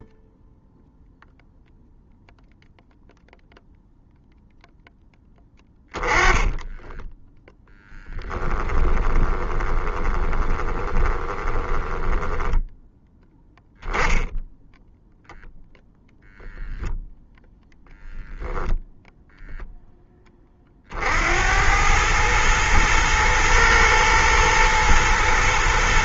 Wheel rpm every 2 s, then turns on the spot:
0, 0, 10, 10, 20, 20, 10, 0, 0, 0, 60, 110, 110.
6-12